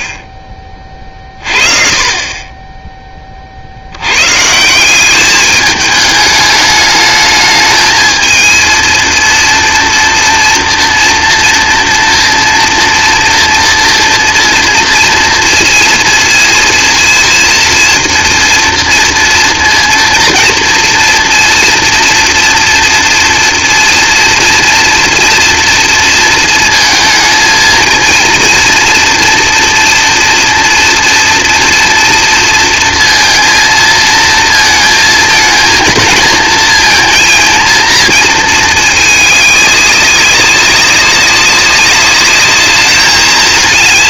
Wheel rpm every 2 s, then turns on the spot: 30, 20, 160, 210, 230, 230, 240, 230, 230, 230, 230, 230, 230, 230, 230, 230, 230, 230, 220, 220, 190, 210.
none